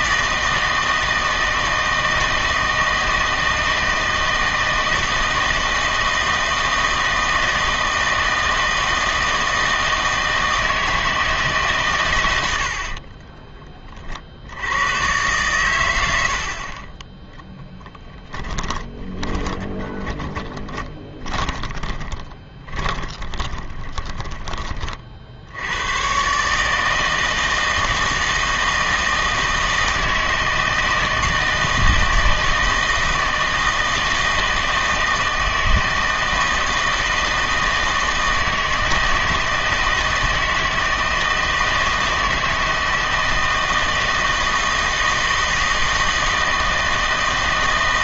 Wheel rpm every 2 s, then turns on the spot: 160, 160, 160, 160, 160, 160, 90, 90, 50, 10, 20, 20, 30, 140, 160, 160, 160, 160, 160, 160, 160, 160, 160, 160.
18-24